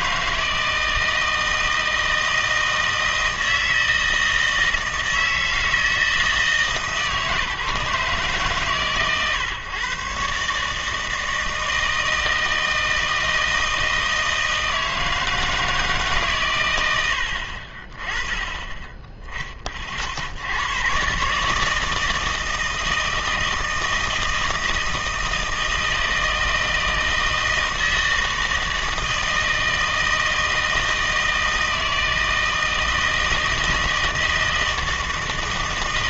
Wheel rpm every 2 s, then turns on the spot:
160, 160, 160, 150, 140, 150, 160, 160, 100, 20, 110, 160, 160, 160, 160, 160, 160, 160.
none